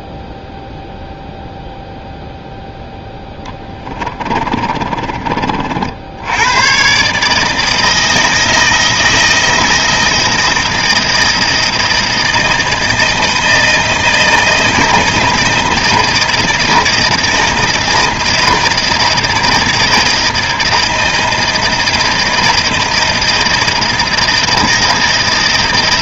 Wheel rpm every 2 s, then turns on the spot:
0, 0, 40, 110, 160, 160, 160, 160, 160, 160, 160, 160, 160.
4-6